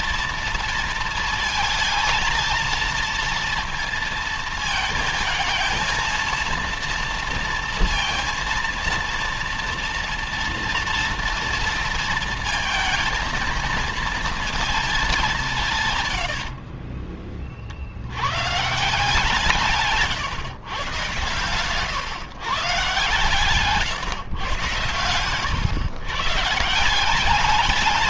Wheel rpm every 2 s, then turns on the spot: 230, 230, 230, 230, 230, 230, 230, 220, 50, 150, 130, 140, 120, 160.
16-18